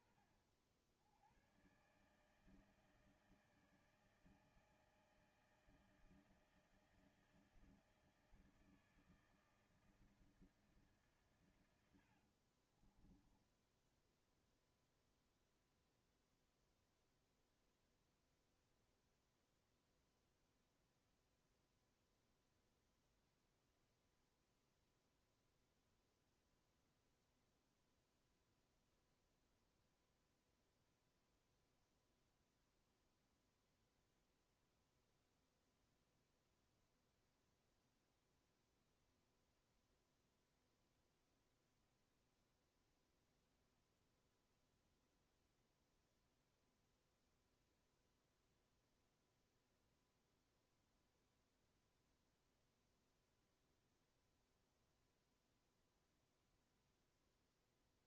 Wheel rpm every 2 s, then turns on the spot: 60, 160, 160, 160, 160, 140, 30, 0, 0, 0, 0, 0, 0, 0, 0, 0, 0, 0, 0, 0, 0, 0, 0, 0, 0, 0, 0, 0, 0.
12-14